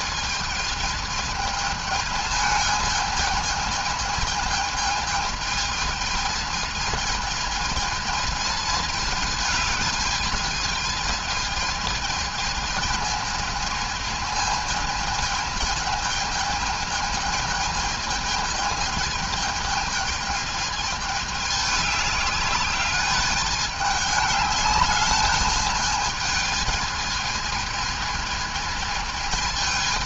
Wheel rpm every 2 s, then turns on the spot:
220, 220, 220, 220, 210, 220, 220, 220, 220, 220, 210, 210, 210, 220, 220.
none